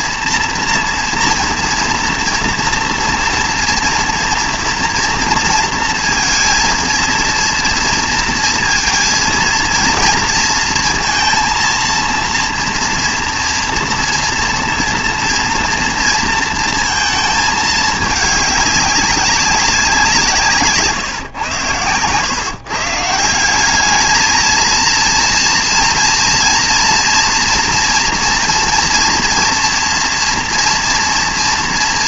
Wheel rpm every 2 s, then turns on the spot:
240, 230, 230, 230, 230, 230, 230, 240, 230, 200, 150, 130, 220, 230, 230, 230.
none